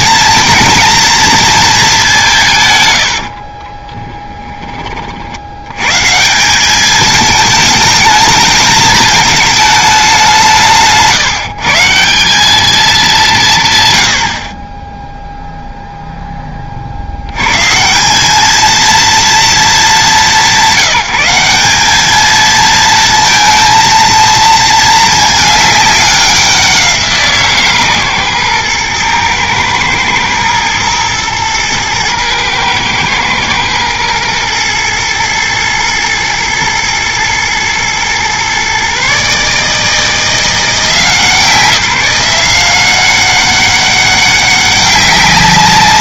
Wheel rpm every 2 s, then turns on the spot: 230, 130, 20, 190, 210, 160, 200, 20, 20, 220, 200, 230, 220, 180, 120, 110, 110, 110, 110, 130, 160, 180, 200.
none